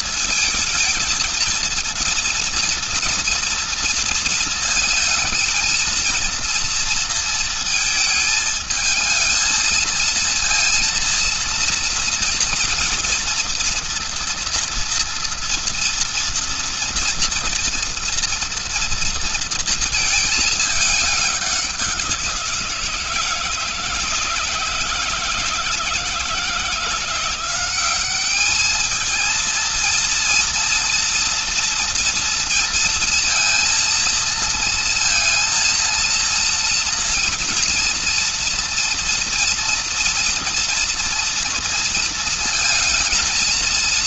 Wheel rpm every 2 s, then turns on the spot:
230, 230, 220, 230, 220, 230, 230, 230, 230, 230, 210, 170, 160, 160, 210, 230, 230, 220, 230, 230, 230, 220.
none